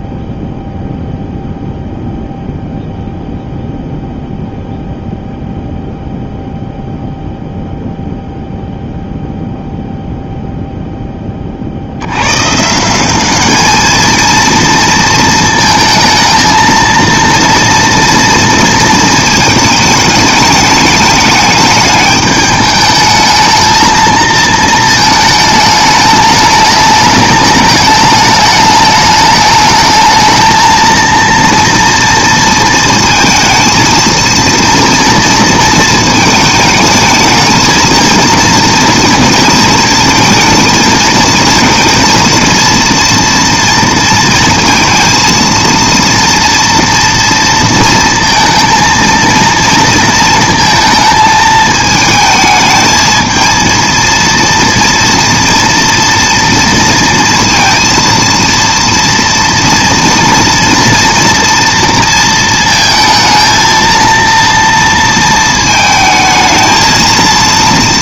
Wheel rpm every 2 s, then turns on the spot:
0, 0, 0, 0, 0, 10, 190, 230, 230, 230, 210, 220, 220, 210, 210, 230, 230, 230, 220, 230, 220, 230, 230, 230, 230, 220, 220, 230, 230, 230, 230, 230, 230, 230.
none